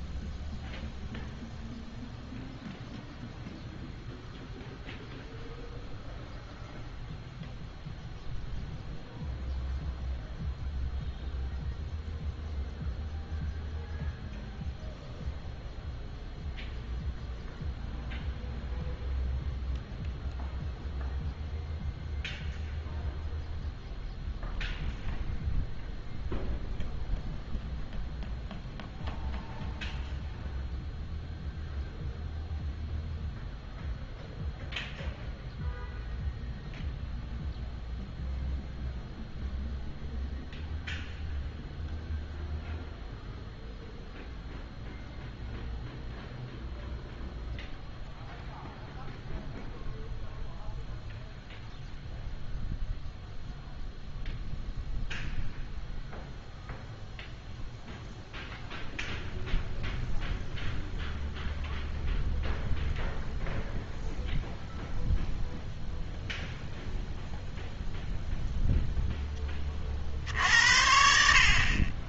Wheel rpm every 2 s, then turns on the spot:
0, 0, 0, 0, 0, 0, 0, 0, 0, 0, 0, 0, 0, 0, 0, 0, 0, 0, 0, 0, 0, 0, 0, 0, 0, 0, 0, 0, 0, 0, 0, 0, 0, 0, 0, 60.
none